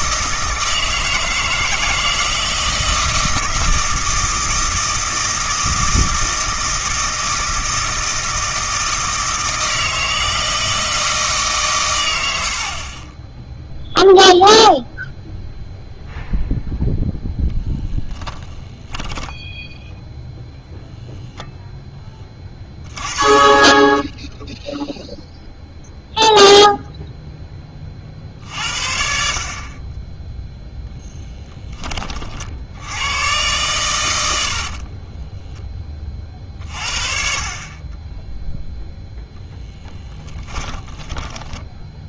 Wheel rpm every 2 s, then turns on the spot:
160, 160, 160, 160, 160, 160, 60, 0, 0, 10, 0, 20, 0, 0, 70, 0, 60, 50, 50, 0, 10.
12-14 34-36 40-42